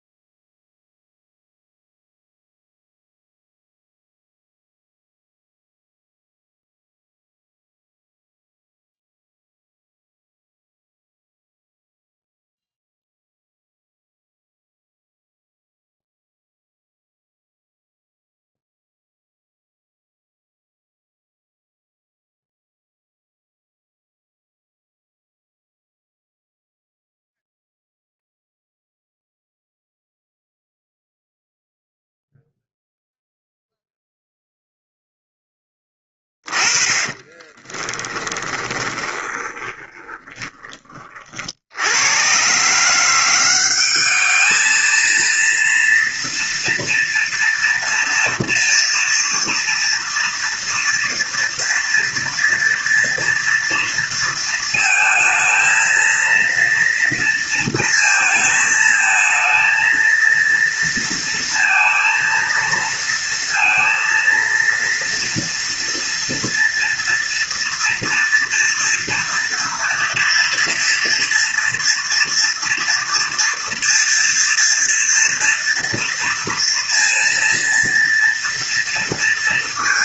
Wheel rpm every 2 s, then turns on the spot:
0, 0, 0, 0, 0, 0, 0, 0, 0, 0, 0, 0, 0, 0, 0, 0, 0, 0, 20, 20, 30, 160, 220, 230, 230, 230, 230, 230, 230, 220, 230, 230, 230, 230, 230, 240, 240, 230, 230, 230.
36-40